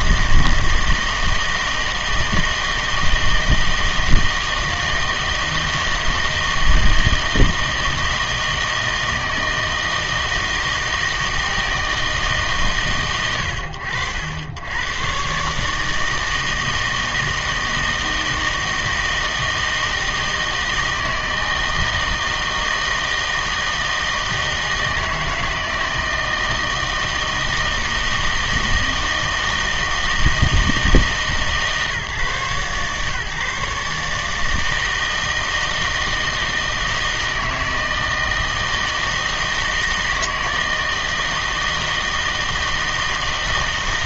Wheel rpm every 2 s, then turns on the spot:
160, 160, 160, 160, 160, 160, 130, 90, 160, 160, 160, 160, 160, 160, 160, 160, 140, 160, 160, 160, 160, 160.
none